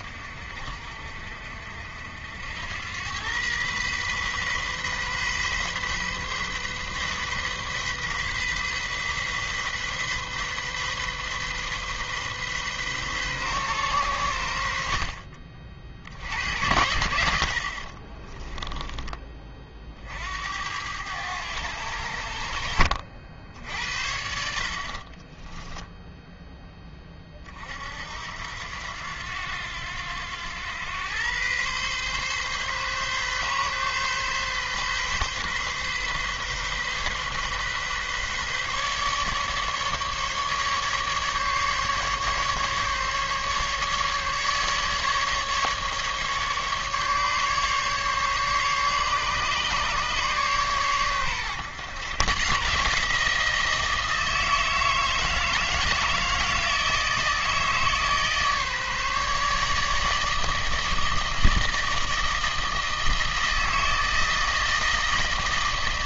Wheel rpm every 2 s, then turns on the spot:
50, 90, 130, 130, 130, 130, 130, 70, 80, 10, 80, 60, 50, 10, 80, 100, 140, 130, 130, 140, 150, 140, 150, 150, 140, 130, 140, 160, 160, 150, 160, 160, 160.
18-20 24-26